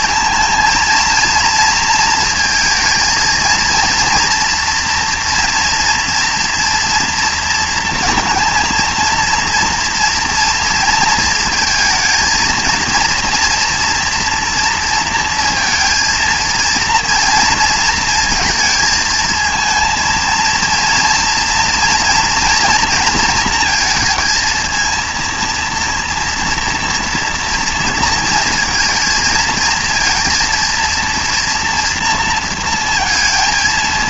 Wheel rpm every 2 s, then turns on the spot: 230, 230, 230, 240, 230, 230, 230, 230, 230, 220, 230, 230, 230, 230, 230, 230, 230.
none